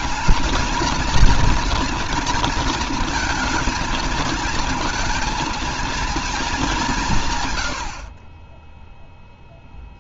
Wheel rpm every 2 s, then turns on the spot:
230, 230, 220, 210, 20.
8-10